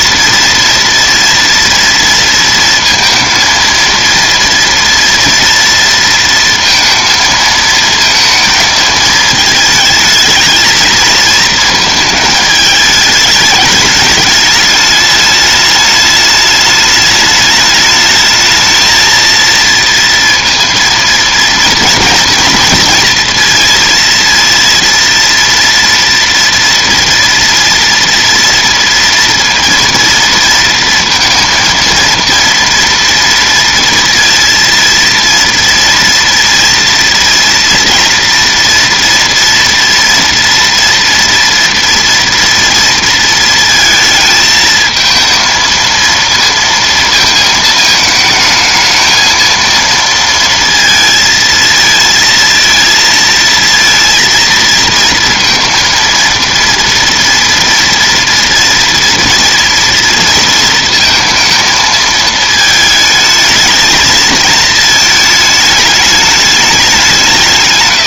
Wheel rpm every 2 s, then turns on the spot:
230, 230, 240, 230, 220, 220, 210, 210, 210, 220, 230, 230, 230, 230, 230, 230, 230, 230, 230, 230, 230, 230, 220, 230, 220, 230, 230, 230, 230, 230, 230, 220, 220, 210.
none